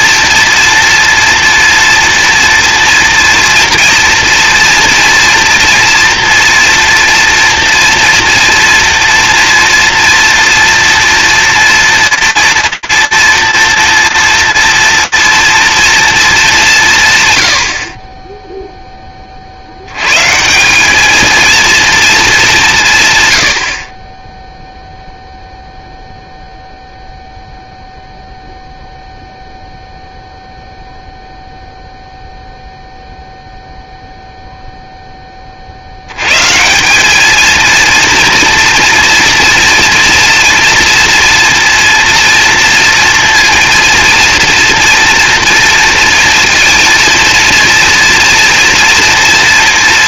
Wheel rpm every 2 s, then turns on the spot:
240, 240, 230, 230, 240, 230, 230, 240, 190, 10, 190, 170, 0, 0, 0, 0, 0, 20, 220, 240, 230, 230, 240, 230, 230.
none